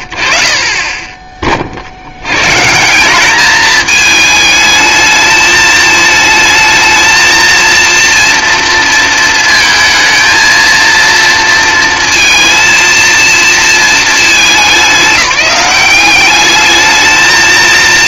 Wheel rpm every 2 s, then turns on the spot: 50, 150, 220, 220, 230, 230, 230, 210, 210.
none